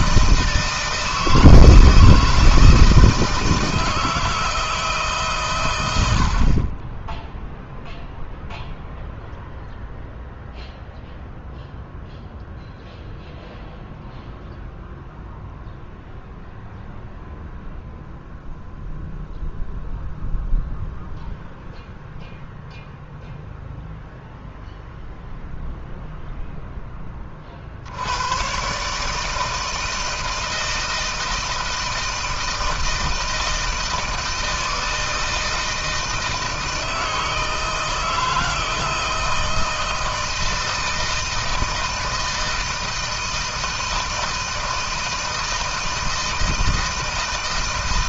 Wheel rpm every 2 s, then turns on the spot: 160, 160, 160, 50, 0, 0, 0, 0, 0, 0, 0, 0, 0, 10, 130, 160, 160, 160, 160, 160, 160, 160, 160, 160.
none